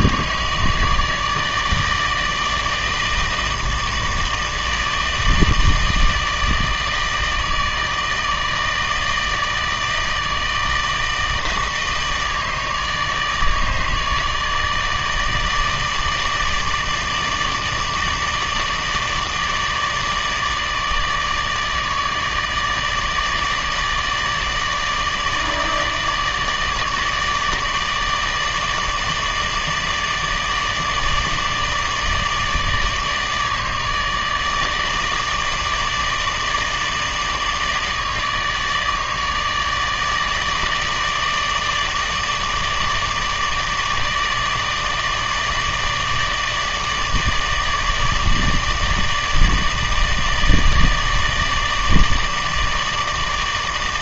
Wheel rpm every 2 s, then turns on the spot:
150, 160, 160, 160, 160, 160, 160, 150, 150, 160, 150, 160, 150, 150, 160, 150, 150, 160, 150, 150, 160, 160, 160, 150, 160, 160, 150.
none